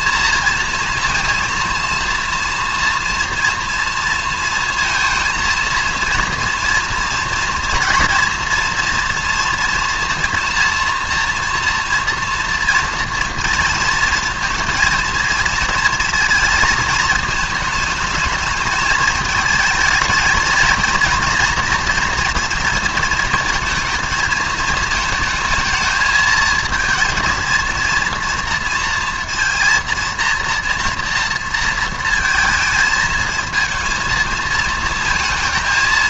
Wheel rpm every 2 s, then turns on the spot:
230, 230, 230, 230, 240, 230, 230, 220, 230, 210, 230, 230, 220, 230, 230, 240, 220, 220.
none